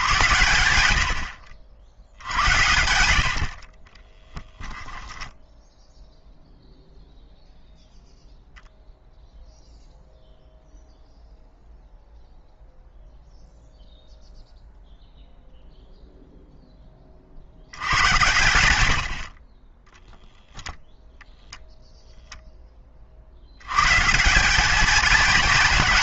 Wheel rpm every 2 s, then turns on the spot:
90, 90, 10, 0, 0, 0, 0, 0, 10, 90, 0, 10, 200.
none